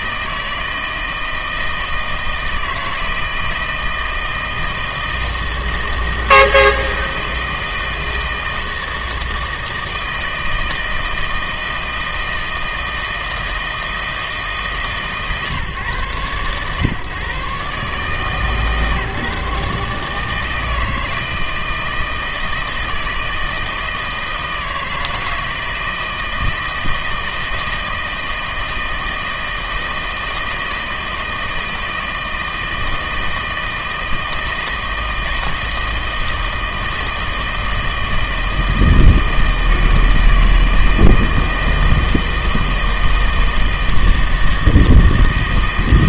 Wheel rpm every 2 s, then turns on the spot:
160, 160, 160, 160, 160, 160, 160, 150, 130, 150, 160, 160, 160, 160, 160, 160, 160, 160, 160, 160, 160, 160, 160.
none